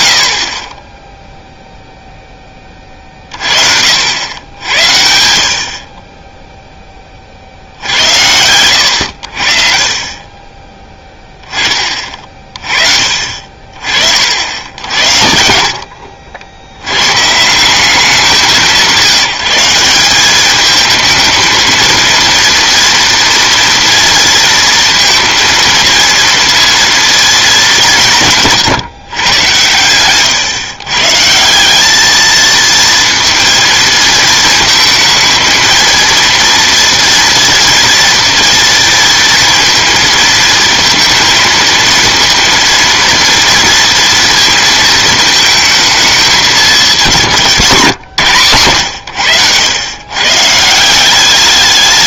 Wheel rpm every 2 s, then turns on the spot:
30, 20, 90, 0, 90, 10, 30, 70, 80, 180, 220, 230, 230, 230, 150, 140, 230, 220, 230, 230, 220, 230, 230, 200, 120, 160.
none